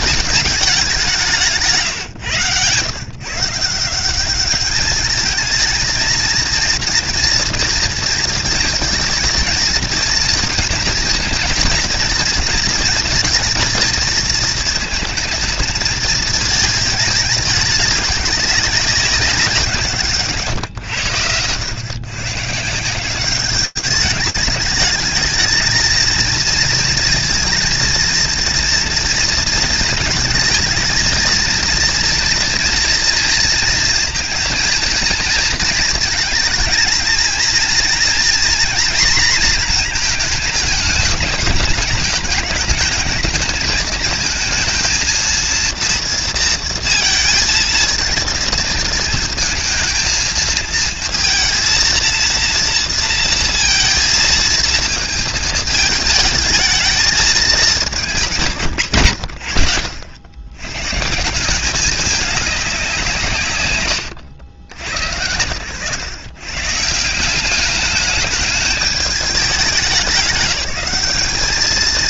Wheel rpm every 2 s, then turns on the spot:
190, 130, 210, 230, 230, 230, 230, 220, 220, 200, 120, 170, 220, 230, 230, 230, 230, 230, 230, 230, 210, 210, 230, 230, 230, 230, 230, 220, 220, 120, 150, 160, 100, 180, 210, 200.
none